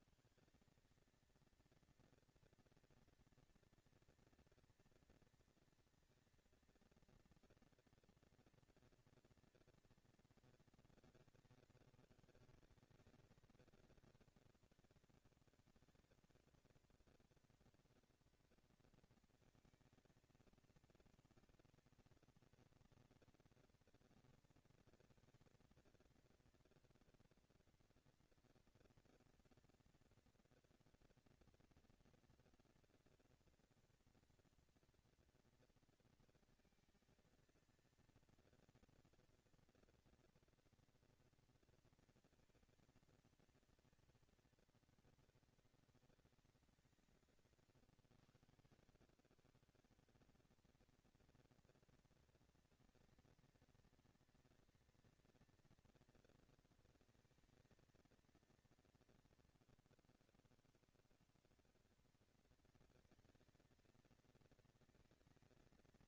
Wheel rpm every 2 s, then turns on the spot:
200, 230, 230, 230, 230, 220, 180, 200, 210, 220, 220, 230, 230, 230, 230, 230, 240, 230, 230, 230, 230, 230, 230, 200, 110, 190, 230, 230, 230, 220, 140, 220, 220.
none